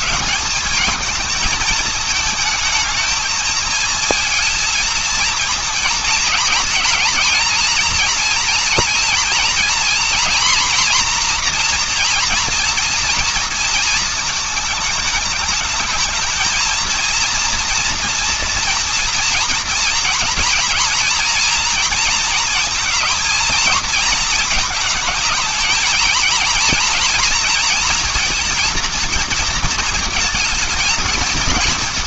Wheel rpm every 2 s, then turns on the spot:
210, 220, 230, 220, 240, 240, 230, 220, 220, 240, 230, 230, 220, 230, 230, 220.
none